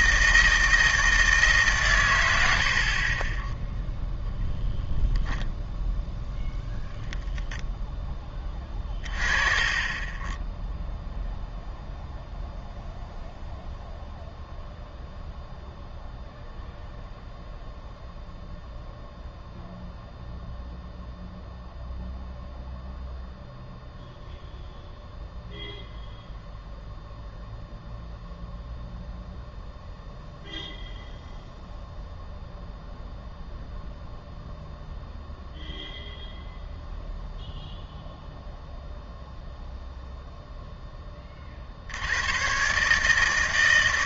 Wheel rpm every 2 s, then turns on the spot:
160, 70, 10, 0, 30, 0, 0, 0, 0, 0, 0, 0, 0, 0, 0, 0, 0, 0, 0, 0, 10, 130.
none